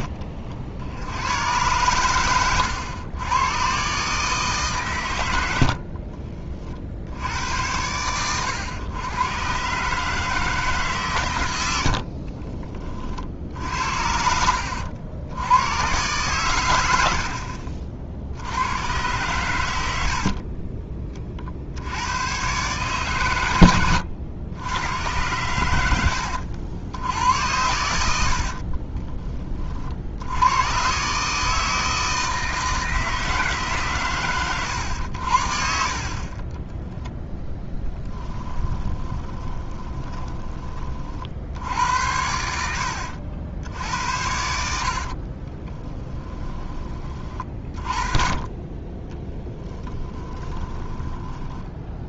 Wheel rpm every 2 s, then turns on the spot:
70, 100, 130, 60, 100, 140, 40, 80, 90, 100, 20, 130, 100, 80, 40, 120, 160, 110, 20, 20, 30, 80, 60, 30, 20, 10.
20-22 28-30 36-40 42-46 50-52